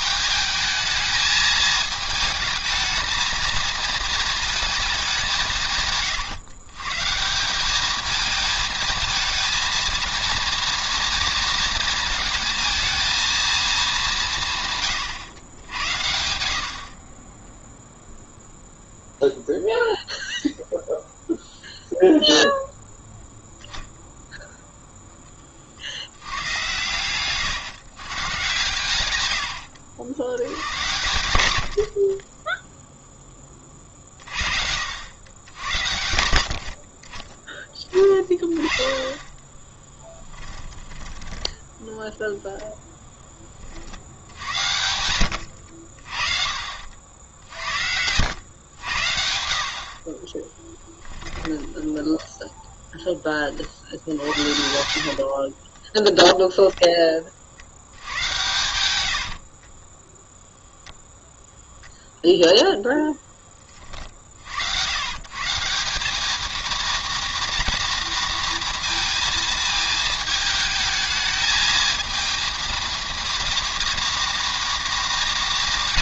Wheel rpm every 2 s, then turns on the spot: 220, 220, 220, 130, 220, 230, 220, 140, 60, 0, 0, 0, 0, 120, 100, 100, 0, 70, 50, 20, 10, 0, 80, 60, 90, 20, 10, 70, 10, 100, 0, 0, 90, 230, 230, 220, 230, 220.
40-42 46-48 50-52 54-56 58-60